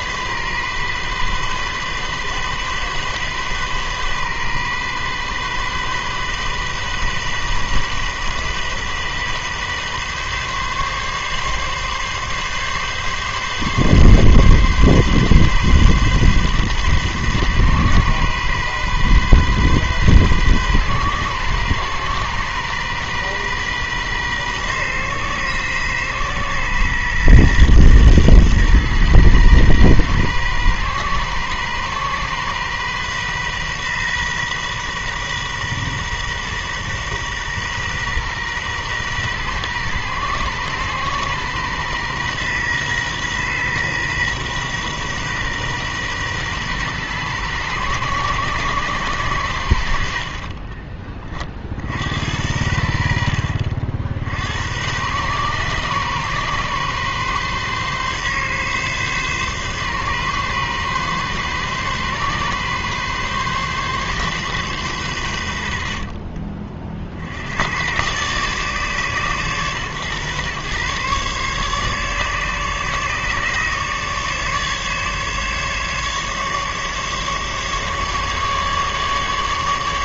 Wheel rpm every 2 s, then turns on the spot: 130, 130, 130, 130, 130, 140, 140, 140, 130, 130, 130, 130, 130, 130, 120, 130, 130, 130, 130, 120, 120, 120, 130, 120, 130, 30, 80, 90, 140, 130, 140, 140, 120, 30, 140, 120, 140, 150, 150, 150.
none